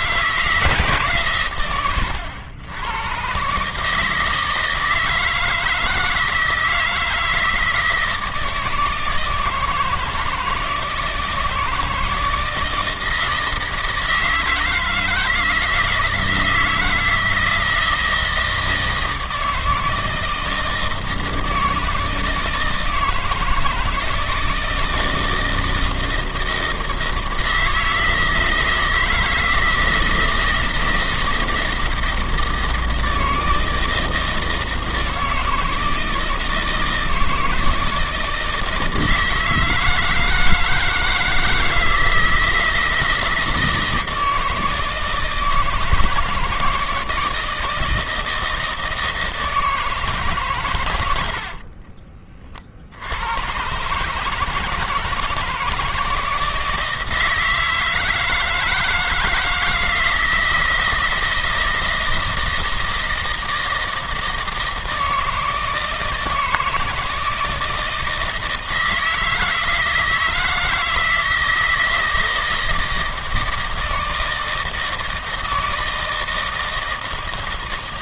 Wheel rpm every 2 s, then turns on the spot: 150, 110, 160, 160, 160, 160, 160, 160, 160, 160, 160, 160, 160, 160, 160, 160, 160, 160, 160, 160, 160, 160, 160, 160, 160, 100, 60, 160, 160, 160, 160, 160, 160, 160, 160, 160, 160, 160, 160.
50-52